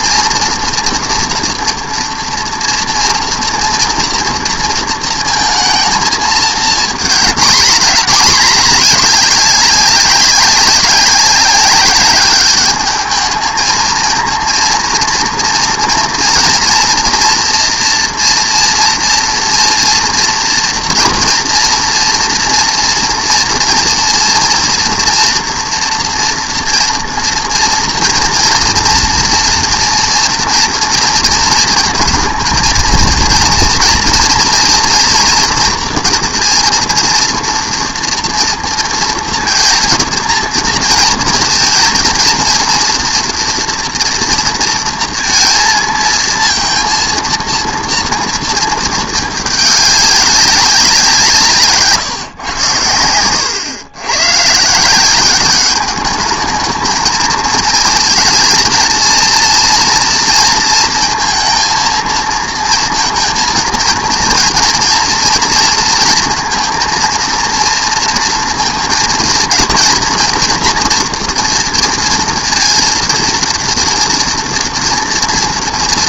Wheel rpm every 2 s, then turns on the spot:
240, 230, 230, 220, 210, 190, 210, 230, 240, 230, 240, 240, 230, 230, 230, 230, 230, 230, 230, 230, 230, 230, 230, 230, 230, 190, 120, 150, 220, 230, 230, 230, 230, 230, 230, 240, 230, 240.
none